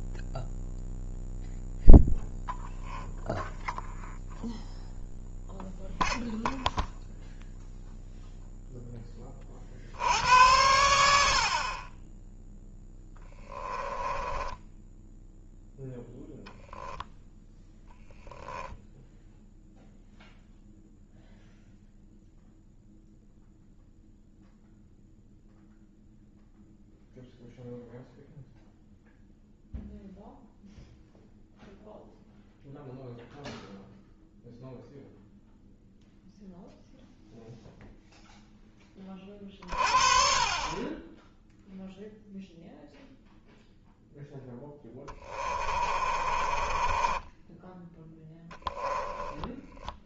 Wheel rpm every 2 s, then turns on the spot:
0, 0, 0, 0, 0, 80, 10, 10, 0, 0, 0, 0, 0, 0, 0, 0, 0, 0, 0, 10, 20, 0, 10, 30, 10.
14-16 44-50